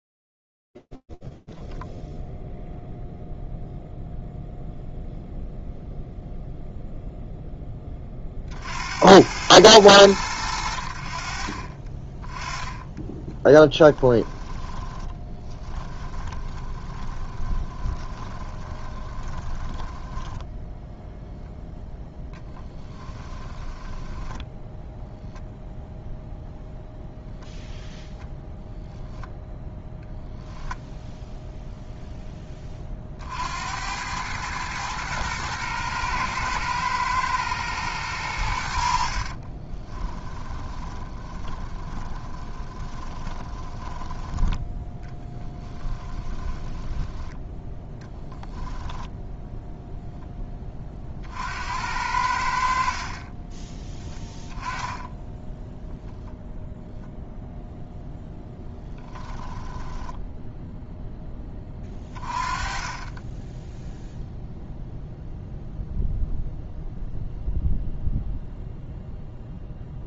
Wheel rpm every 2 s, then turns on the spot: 0, 0, 80, 60, 10, 10, 30, 20, 10, 10, 10, 0, 0, 0, 0, 60, 110, 110, 50, 20, 20, 10, 20, 10, 20, 60, 10, 0, 0, 10, 30, 0, 0, 0, 10.
10-18 20-22 36-42 44-46 52-54 58-60 68-70